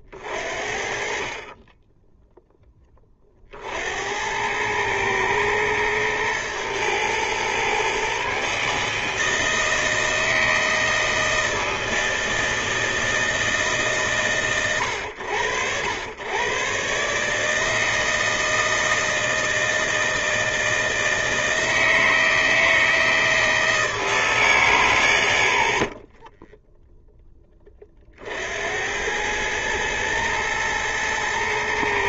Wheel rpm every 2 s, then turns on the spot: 40, 10, 110, 120, 140, 160, 160, 110, 120, 160, 160, 160, 150, 20, 70, 110.
26-28